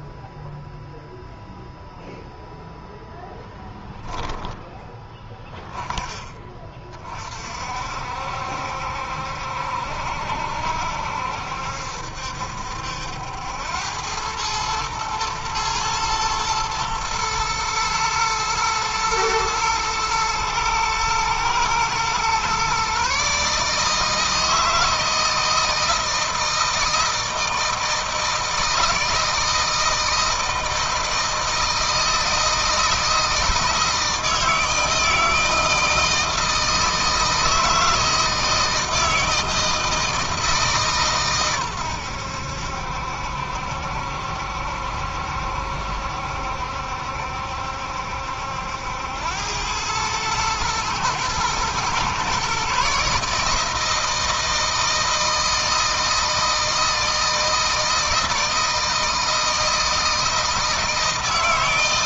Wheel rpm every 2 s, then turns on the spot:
0, 0, 10, 20, 70, 70, 70, 110, 110, 110, 110, 130, 160, 160, 160, 160, 160, 160, 160, 160, 150, 70, 70, 70, 80, 110, 140, 160, 160, 160, 160.
none